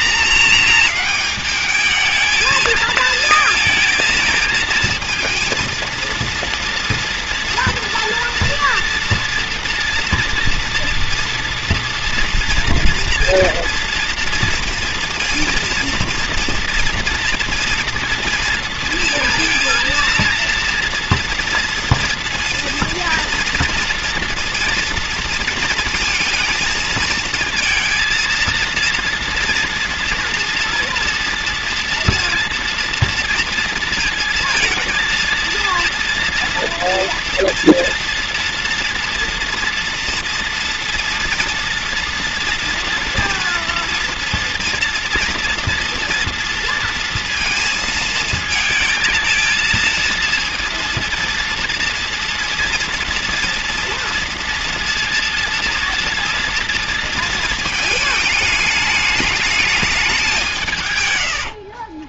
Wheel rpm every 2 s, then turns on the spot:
220, 220, 230, 230, 230, 240, 230, 230, 230, 230, 230, 230, 230, 220, 230, 230, 230, 230, 230, 240, 230, 240, 240, 230, 220, 230, 230, 240, 230, 210, 150.
none